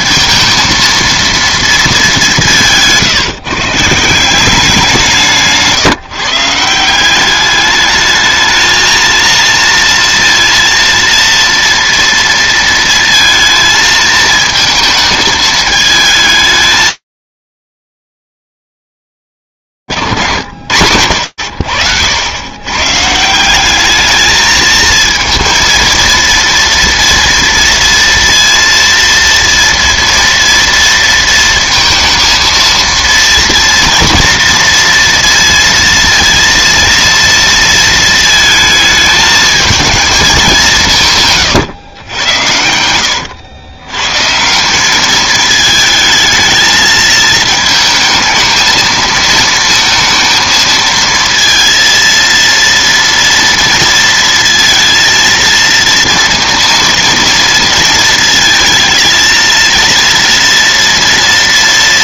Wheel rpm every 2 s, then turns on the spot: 230, 170, 190, 170, 220, 230, 230, 220, 220, 210, 180, 80, 200, 230, 230, 230, 230, 230, 230, 230, 220, 130, 120, 220, 220, 220, 230, 230, 230, 230, 230.
22-24